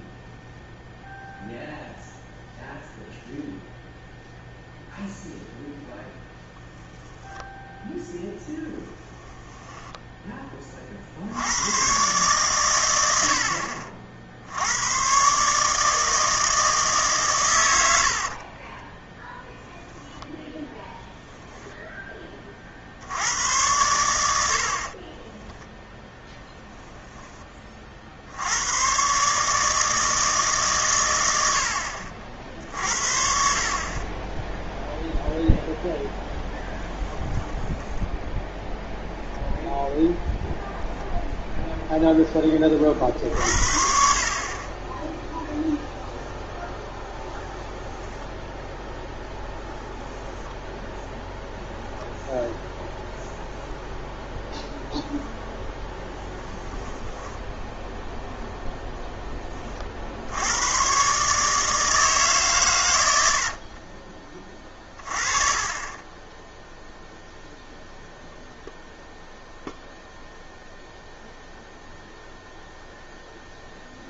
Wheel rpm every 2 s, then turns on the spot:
0, 0, 0, 0, 10, 60, 90, 120, 130, 0, 10, 80, 40, 10, 140, 110, 60, 0, 10, 0, 0, 40, 10, 10, 10, 0, 0, 0, 10, 10, 130, 90, 30, 0, 0, 0, 0.
8-10 24-26 36-38 62-64